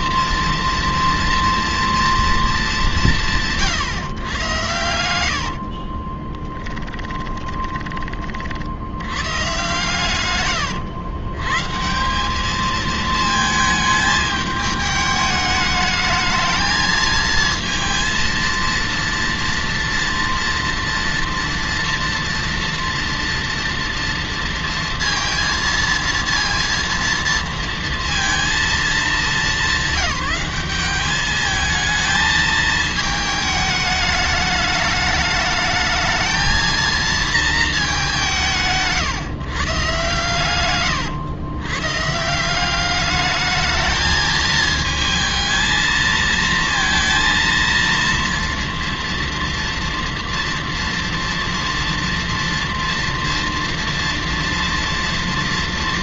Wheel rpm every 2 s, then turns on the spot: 230, 150, 50, 20, 120, 150, 220, 220, 230, 230, 240, 230, 230, 230, 210, 210, 220, 210, 220, 130, 110, 210, 220, 230, 230, 230, 230, 230.
4-6